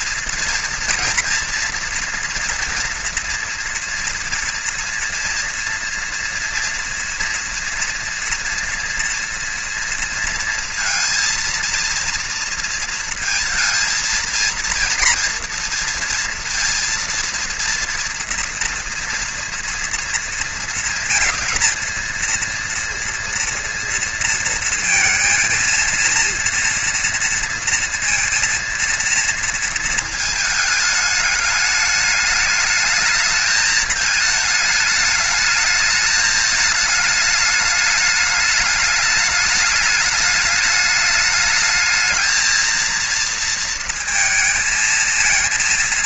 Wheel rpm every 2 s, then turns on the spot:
230, 230, 230, 230, 230, 230, 230, 230, 230, 230, 230, 230, 230, 230, 230, 220, 210, 220, 210, 210, 210, 220, 230.
none